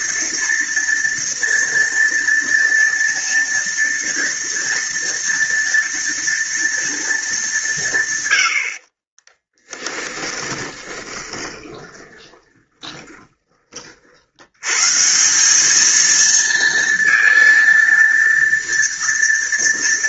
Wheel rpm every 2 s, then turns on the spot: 230, 230, 230, 230, 40, 20, 20, 160, 230, 230.
8-14